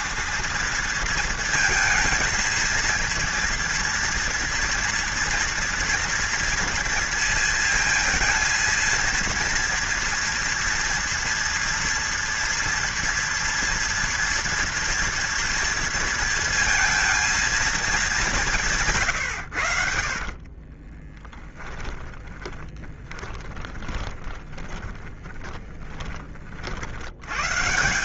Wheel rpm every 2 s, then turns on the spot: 230, 230, 230, 230, 230, 230, 230, 230, 230, 170, 30, 20, 30, 50.
20-26